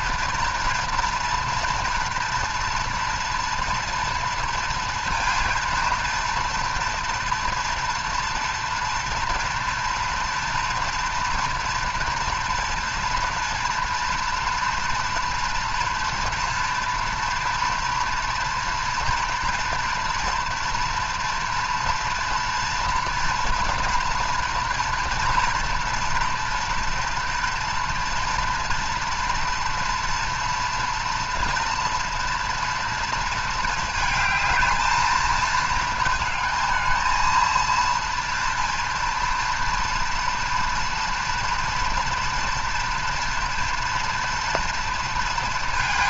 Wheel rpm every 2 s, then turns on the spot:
230, 230, 230, 230, 230, 230, 230, 230, 230, 230, 230, 230, 230, 230, 240, 230, 230, 220, 220, 230, 240, 230, 230.
none